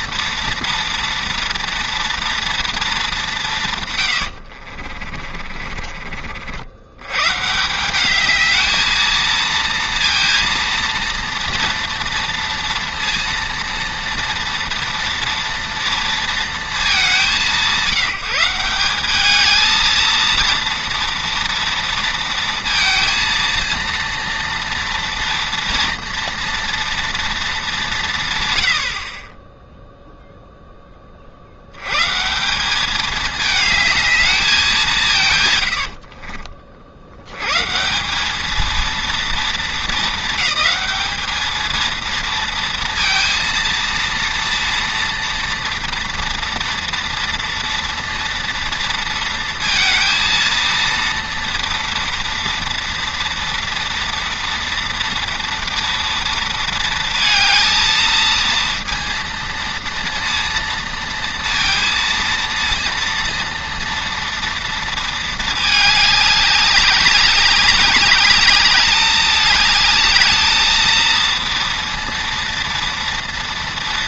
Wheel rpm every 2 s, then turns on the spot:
230, 230, 50, 80, 220, 230, 230, 230, 220, 190, 230, 230, 230, 230, 100, 10, 190, 200, 50, 220, 220, 230, 230, 230, 230, 230, 230, 230, 230, 230, 230, 230, 230, 200, 210, 220, 230.
4-6